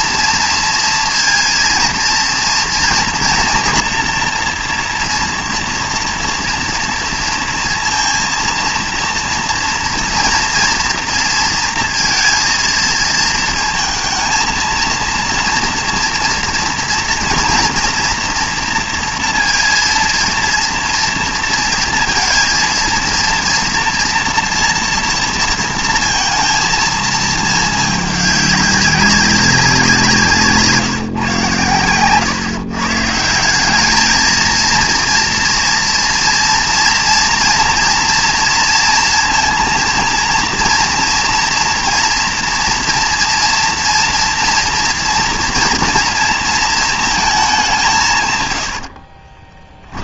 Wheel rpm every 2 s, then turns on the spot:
230, 230, 230, 230, 230, 230, 230, 230, 240, 230, 230, 230, 230, 230, 200, 150, 130, 230, 230, 230, 230, 230, 230, 220, 90.
none